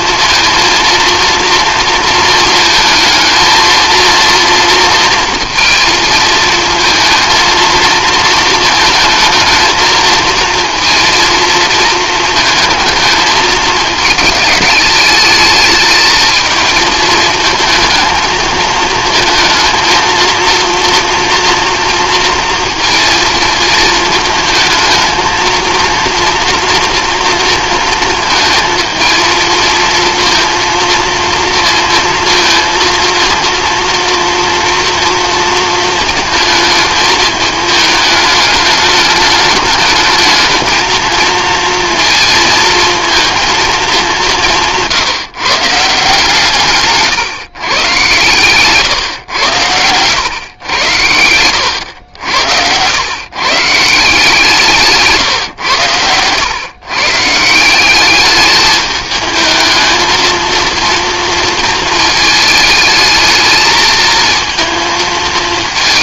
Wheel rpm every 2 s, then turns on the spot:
230, 220, 230, 230, 220, 230, 220, 210, 220, 220, 230, 230, 220, 230, 230, 230, 230, 230, 220, 210, 230, 220, 160, 140, 130, 100, 100, 160, 130, 210, 230, 220, 230.
48-50